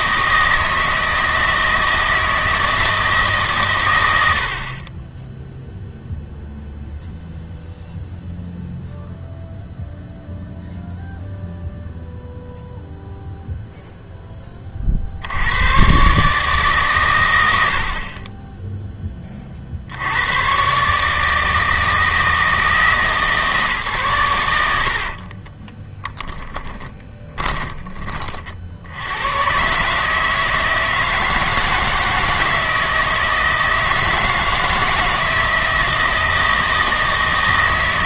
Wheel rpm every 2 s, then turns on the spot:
160, 160, 40, 0, 0, 0, 0, 30, 140, 10, 130, 160, 90, 20, 60, 160, 160, 160, 160.
24-28